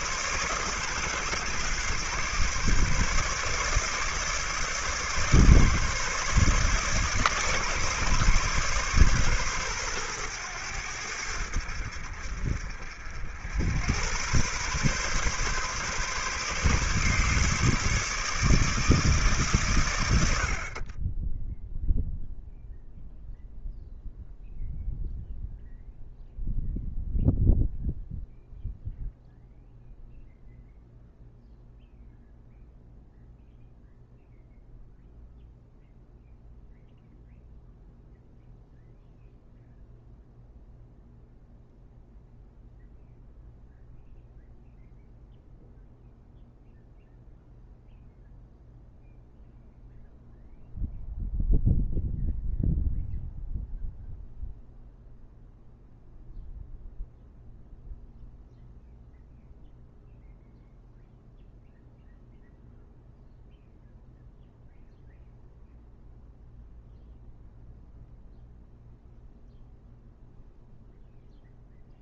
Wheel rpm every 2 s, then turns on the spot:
140, 140, 150, 150, 140, 90, 60, 130, 140, 150, 30, 0, 0, 0, 0, 0, 0, 0, 0, 0, 0, 0, 0, 0, 0, 0, 0, 0, 0, 0, 0, 0, 0, 0, 0, 0.
none